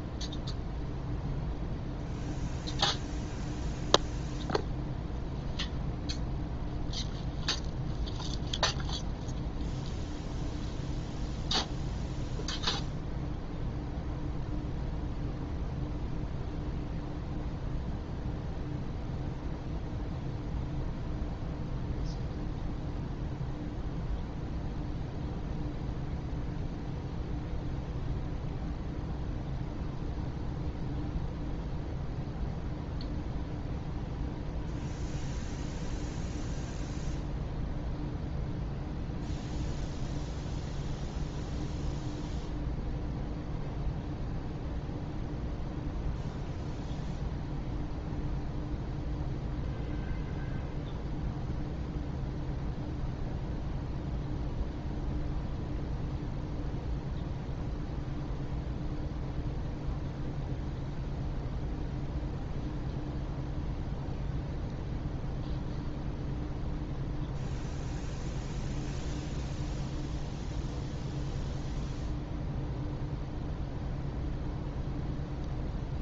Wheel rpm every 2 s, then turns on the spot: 0, 0, 0, 0, 0, 0, 0, 0, 0, 0, 0, 0, 0, 0, 0, 0, 0, 0, 0, 0, 0, 0, 0, 0, 0, 0, 0, 0, 0, 0, 0, 0, 0, 0, 0, 0, 0, 0.
none